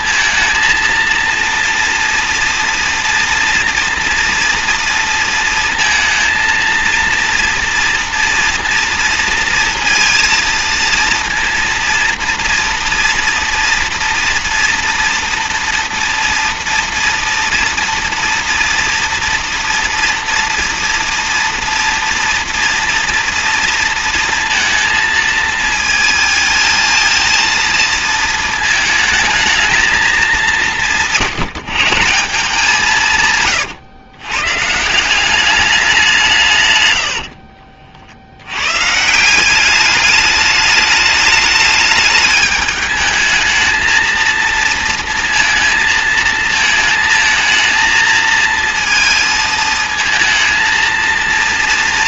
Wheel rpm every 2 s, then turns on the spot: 230, 240, 230, 230, 230, 230, 230, 230, 230, 240, 230, 230, 220, 230, 220, 160, 170, 160, 100, 130, 210, 210, 230, 220, 220, 230.
36-38